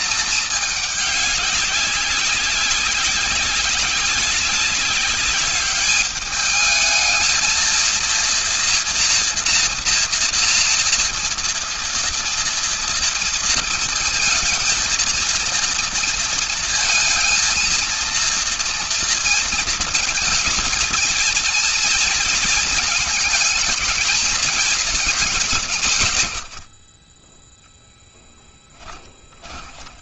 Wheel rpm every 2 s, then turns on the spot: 200, 200, 200, 220, 230, 230, 230, 230, 230, 230, 230, 220, 160, 0, 30.
none